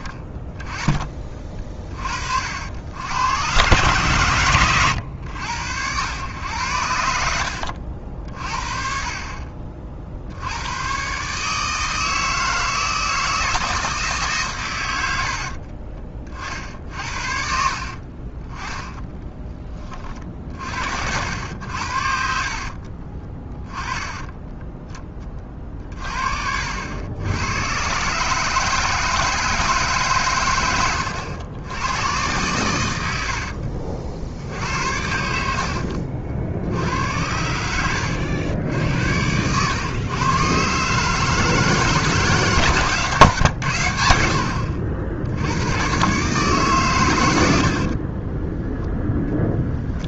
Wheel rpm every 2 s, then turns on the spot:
30, 80, 110, 110, 50, 100, 160, 120, 50, 10, 50, 60, 10, 70, 160, 110, 100, 70, 70, 80, 140, 150, 70, 140, 10.
4-6 22-24 48-50